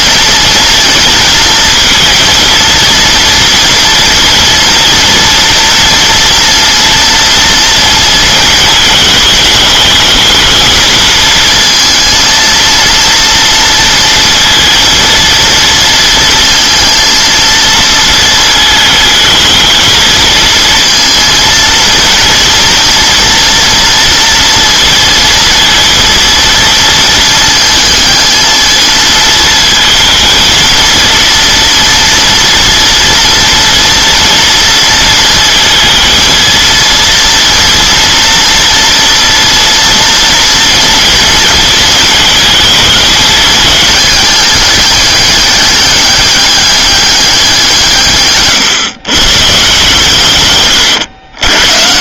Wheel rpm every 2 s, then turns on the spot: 230, 230, 230, 240, 220, 220, 230, 230, 230, 220, 230, 230, 230, 230, 220, 230, 230, 230, 230, 230, 230, 220, 210, 200, 140, 120.
50-52